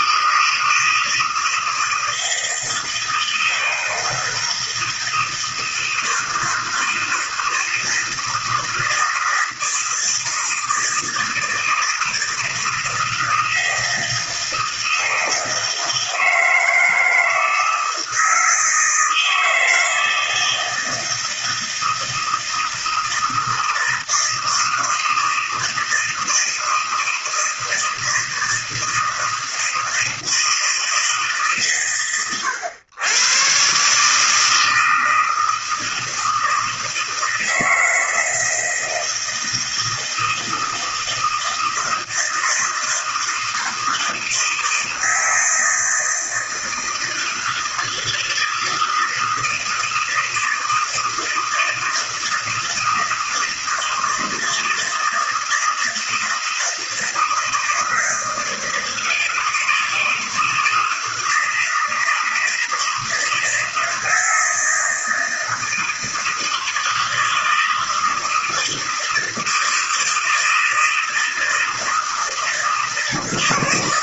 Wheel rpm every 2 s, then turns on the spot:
160, 160, 160, 160, 160, 160, 160, 160, 160, 160, 160, 160, 160, 160, 160, 140, 110, 160, 160, 160, 160, 160, 160, 160, 160, 160, 160, 160, 160, 160, 160, 160, 160, 160, 160, 160, 160.
none